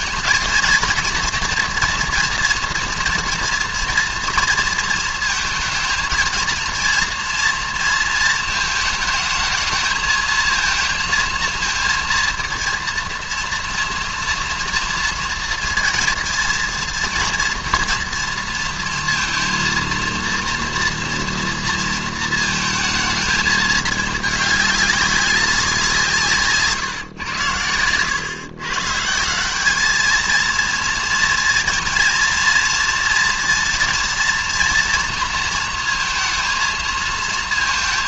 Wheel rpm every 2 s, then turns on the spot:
230, 230, 230, 230, 220, 220, 230, 230, 230, 230, 230, 230, 210, 150, 140, 230, 230, 230, 220.
none